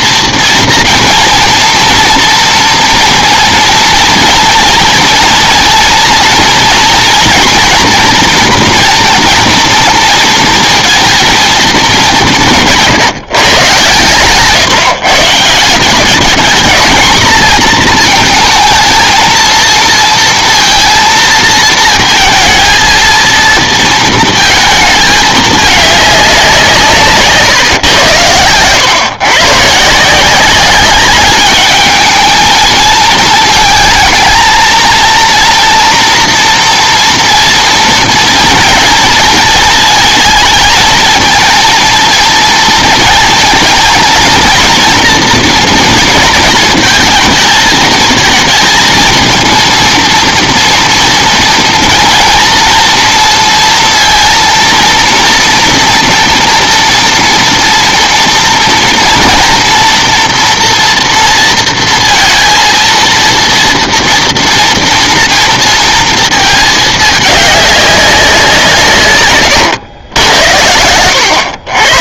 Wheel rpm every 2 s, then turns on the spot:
230, 230, 240, 230, 240, 230, 170, 150, 220, 220, 230, 220, 220, 180, 110, 190, 220, 230, 230, 230, 220, 230, 230, 230, 220, 230, 230, 230, 230, 230, 230, 230, 240, 220, 180, 80.
none